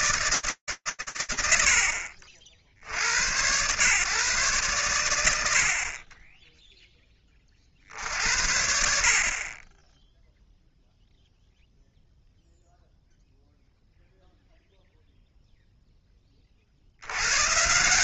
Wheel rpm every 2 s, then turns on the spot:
120, 90, 90, 30, 30, 0, 0, 0, 100.
none